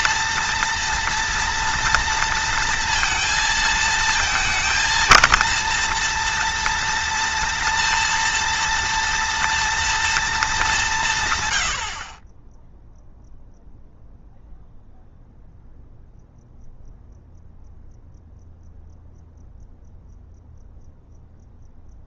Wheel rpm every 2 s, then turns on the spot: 230, 230, 230, 230, 230, 190, 0, 0, 0, 0, 0.
none